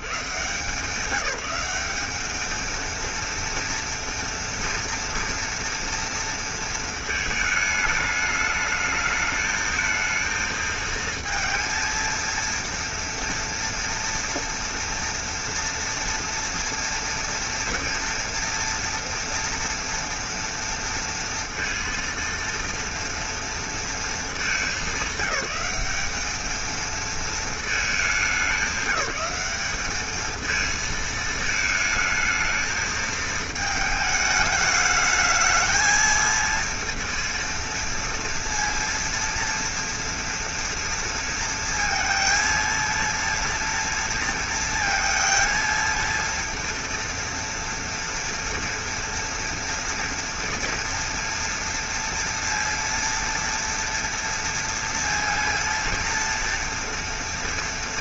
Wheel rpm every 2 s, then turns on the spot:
110, 210, 230, 230, 210, 220, 230, 240, 230, 240, 230, 230, 220, 210, 200, 210, 220, 210, 220, 230, 230, 230, 230, 230, 230, 230, 230, 230, 230.
none